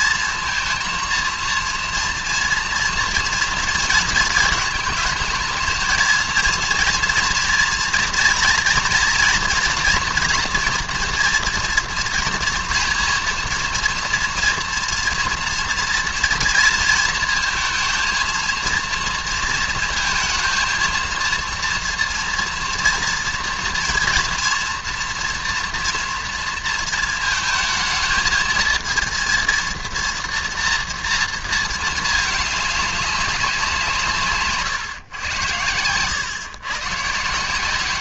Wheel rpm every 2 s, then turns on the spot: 230, 240, 220, 230, 230, 230, 230, 230, 230, 230, 230, 230, 230, 230, 220, 230, 210, 140, 120.
none